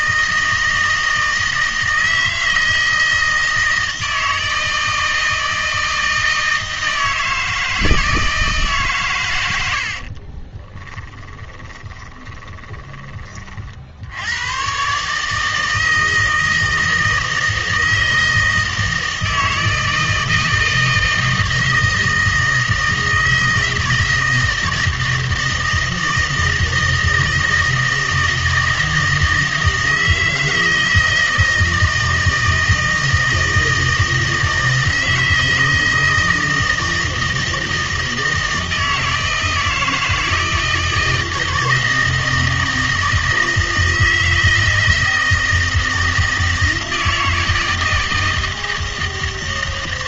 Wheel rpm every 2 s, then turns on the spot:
160, 160, 160, 160, 140, 10, 20, 130, 160, 160, 160, 160, 160, 160, 160, 160, 160, 160, 160, 160, 160, 160, 160, 160, 160.
10-12